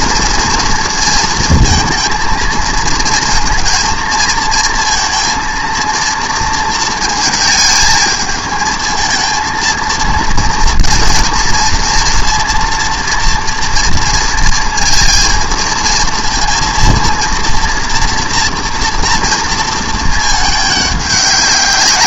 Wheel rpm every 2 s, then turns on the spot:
230, 220, 220, 230, 220, 230, 230, 230, 230, 230, 210.
none